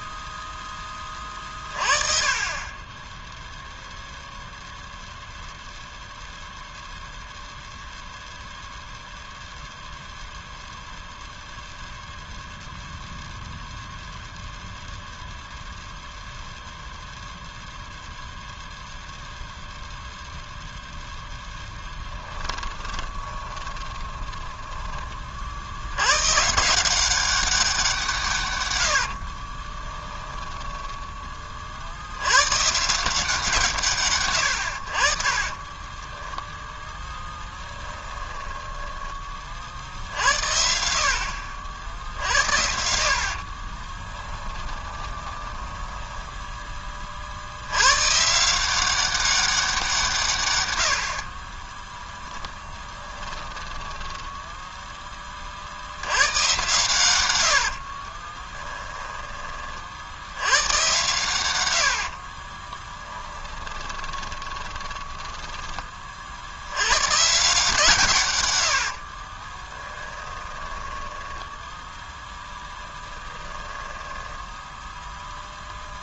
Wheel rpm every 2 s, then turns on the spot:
10, 20, 0, 0, 0, 0, 0, 0, 0, 0, 0, 20, 20, 170, 110, 10, 150, 60, 0, 10, 60, 60, 20, 20, 180, 90, 10, 10, 110, 10, 110, 20, 10, 100, 80, 10, 10, 10.
22-24 28-30 44-46 52-54 58-60 62-66 68-74